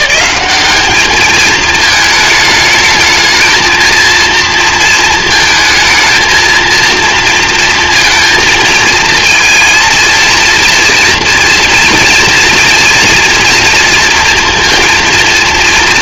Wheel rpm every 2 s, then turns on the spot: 200, 220, 230, 230, 220, 230, 230, 230.
none